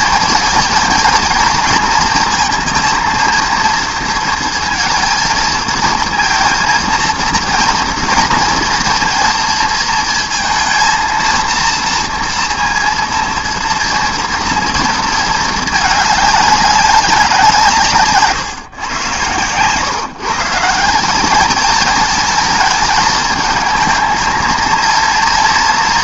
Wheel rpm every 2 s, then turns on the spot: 230, 220, 230, 230, 230, 230, 230, 230, 200, 120, 170, 220, 230.
none